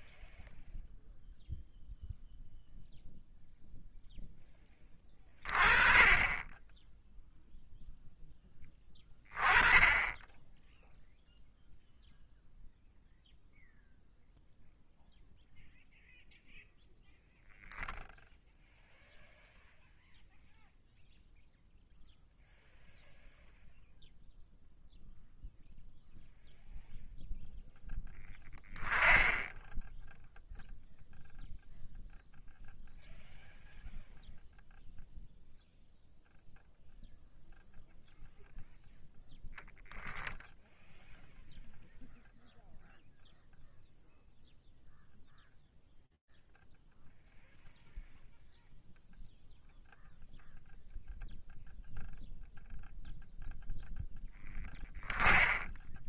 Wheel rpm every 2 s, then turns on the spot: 0, 0, 10, 20, 10, 10, 0, 0, 0, 0, 0, 0, 0, 0, 10, 0, 0, 0, 0, 0, 0, 0, 0, 0, 0, 0, 0, 10.
none